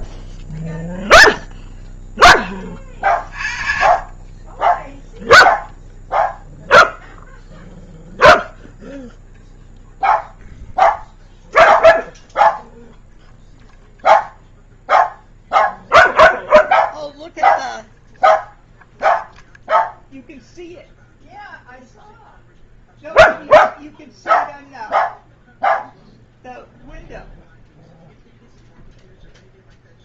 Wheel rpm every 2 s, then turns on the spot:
0, 10, 30, 0, 0, 0, 0, 0, 0, 0, 0, 0, 0, 0, 0.
none